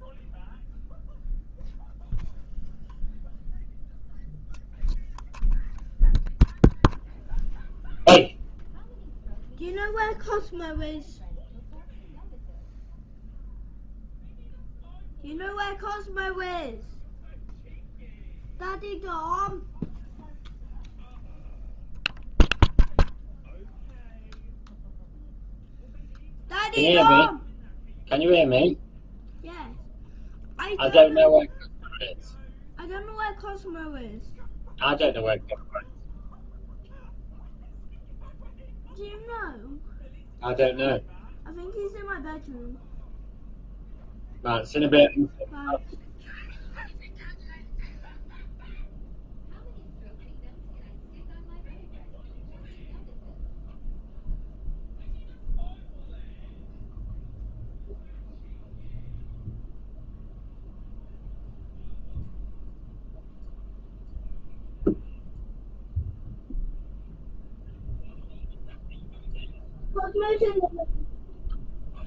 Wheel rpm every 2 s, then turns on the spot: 0, 0, 0, 0, 0, 0, 0, 0, 0, 0, 0, 0, 0, 0, 0, 0, 0, 0, 0, 0, 0, 0, 0, 0, 0, 0, 0, 0, 0, 0, 0, 0, 0, 0, 0, 0.
none